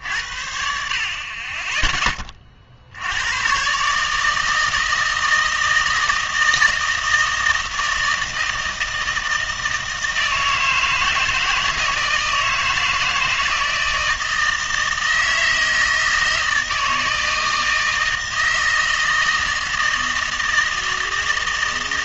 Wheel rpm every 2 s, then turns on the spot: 60, 50, 160, 160, 160, 160, 160, 160, 160, 160, 160.
none